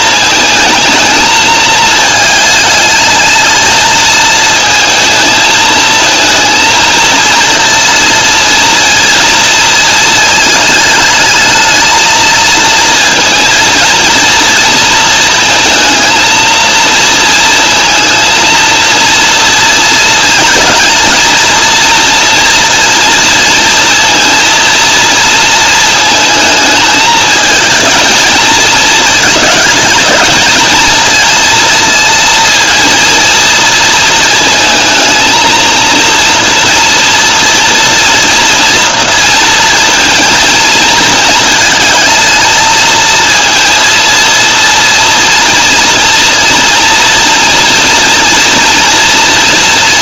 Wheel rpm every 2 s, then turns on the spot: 220, 220, 220, 230, 230, 210, 230, 230, 230, 230, 220, 230, 230, 220, 220, 220, 230, 220, 230, 230, 230, 220, 230, 230, 230.
none